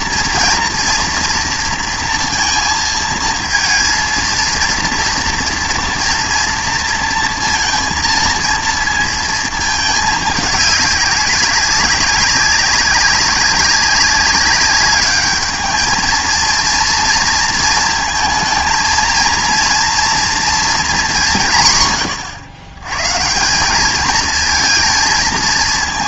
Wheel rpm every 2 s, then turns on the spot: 230, 220, 230, 230, 230, 200, 190, 200, 230, 230, 220, 120, 220.
none